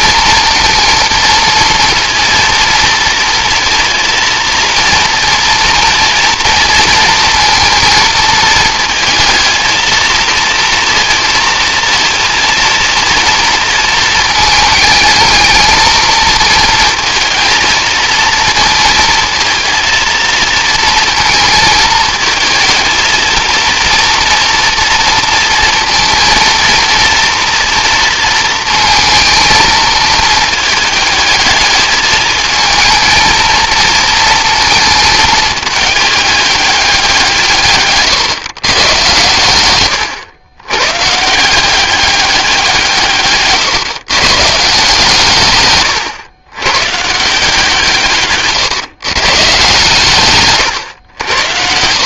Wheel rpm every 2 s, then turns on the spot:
230, 230, 230, 230, 230, 230, 230, 220, 230, 230, 230, 220, 230, 230, 230, 220, 220, 230, 210, 130, 140, 170, 150, 120, 130, 120.
none